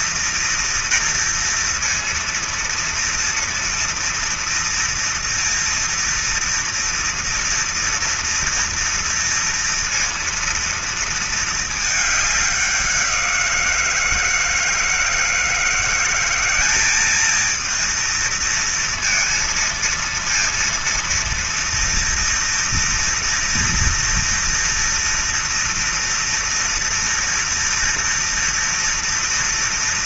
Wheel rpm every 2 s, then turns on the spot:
230, 230, 230, 230, 230, 230, 190, 160, 210, 230, 230, 230, 230, 230, 230.
none